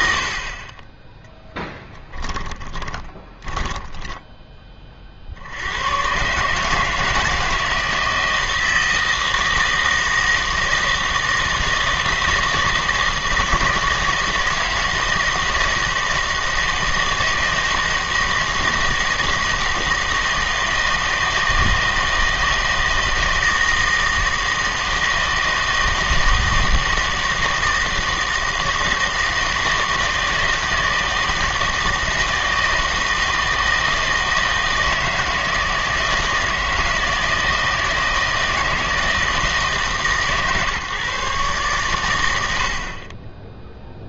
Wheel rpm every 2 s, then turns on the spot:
40, 20, 20, 150, 160, 160, 160, 160, 160, 160, 160, 160, 160, 160, 160, 160, 160, 160, 160, 160, 150, 70.
2-4